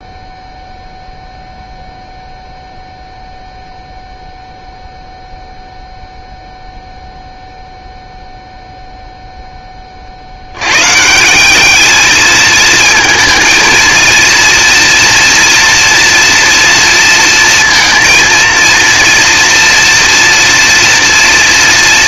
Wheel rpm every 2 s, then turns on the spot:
0, 0, 0, 0, 0, 80, 220, 230, 230, 230, 230.
none